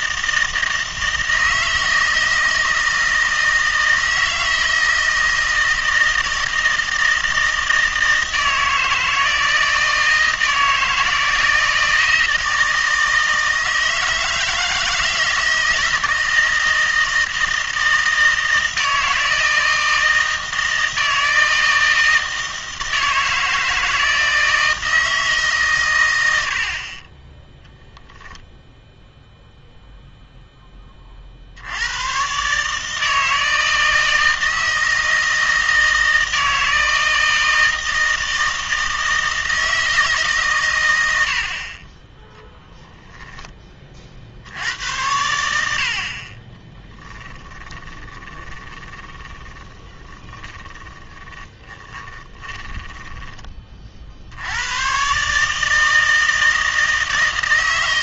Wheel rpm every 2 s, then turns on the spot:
160, 160, 160, 160, 160, 160, 160, 160, 160, 160, 160, 160, 160, 50, 0, 20, 150, 160, 160, 160, 110, 0, 90, 20, 20, 20, 20, 110, 160.
46-54